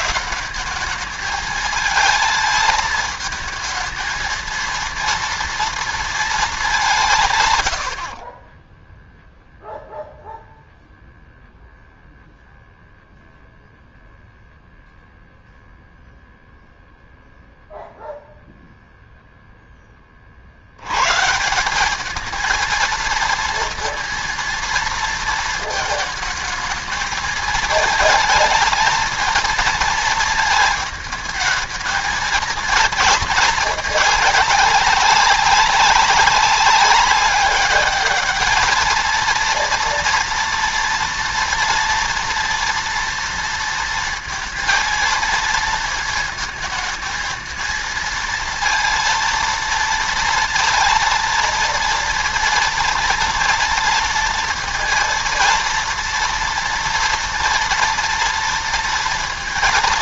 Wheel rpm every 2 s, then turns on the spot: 200, 220, 230, 190, 10, 0, 0, 0, 0, 0, 90, 230, 230, 220, 220, 220, 230, 210, 190, 220, 230, 230, 230, 220, 230, 230, 230, 230, 230, 230.
8-10